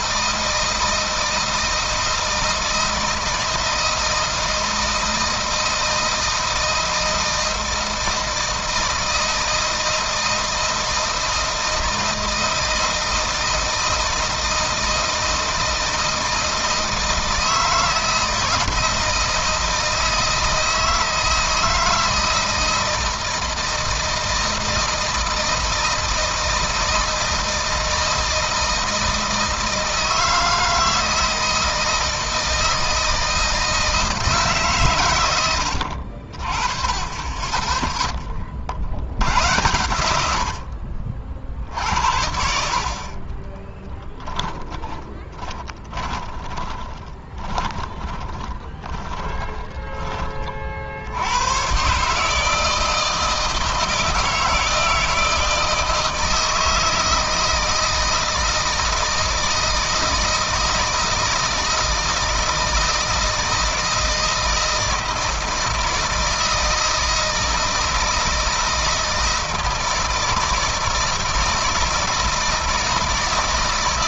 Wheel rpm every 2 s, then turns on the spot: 160, 160, 160, 160, 160, 160, 160, 160, 160, 160, 160, 160, 160, 160, 160, 160, 160, 140, 30, 70, 60, 60, 20, 20, 20, 50, 160, 160, 160, 160, 160, 160, 160, 160, 160, 160, 160.
44-50